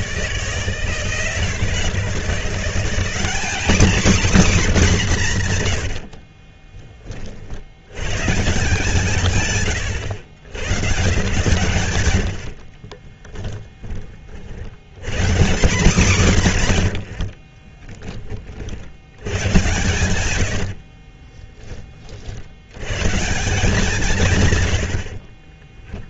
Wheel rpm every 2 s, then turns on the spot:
160, 160, 210, 30, 130, 140, 30, 80, 120, 40, 80, 100, 120.
12-14 20-22